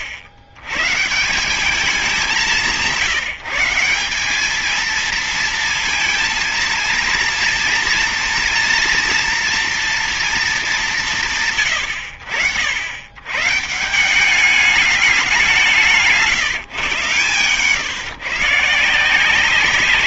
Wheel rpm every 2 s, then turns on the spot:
110, 170, 210, 230, 240, 220, 90, 200, 130, 150.
none